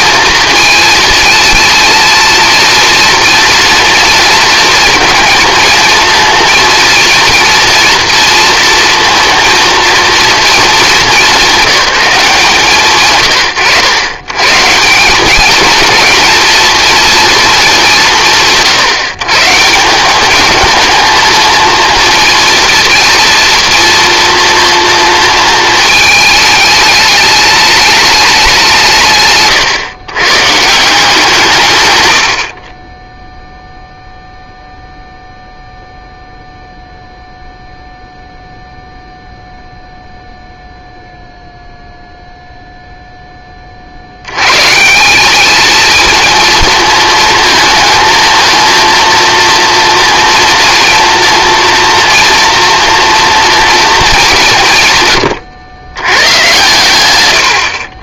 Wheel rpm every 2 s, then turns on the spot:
220, 230, 230, 230, 230, 220, 160, 160, 230, 150, 220, 220, 230, 210, 180, 150, 20, 0, 0, 0, 0, 0, 140, 230, 230, 230, 230, 150, 120.
none